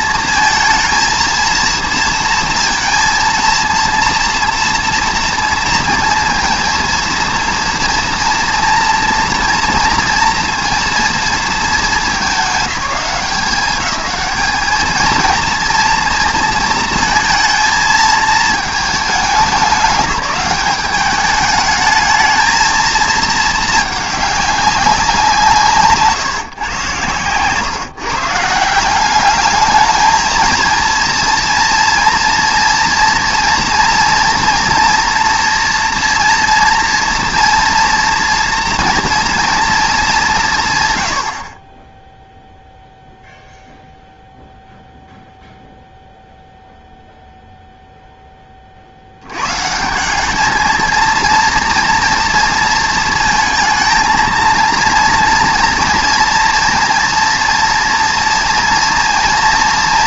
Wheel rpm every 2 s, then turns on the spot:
230, 230, 230, 230, 240, 230, 200, 220, 230, 220, 200, 220, 200, 140, 170, 230, 230, 240, 240, 230, 160, 0, 0, 0, 30, 220, 230, 230, 230, 230.
none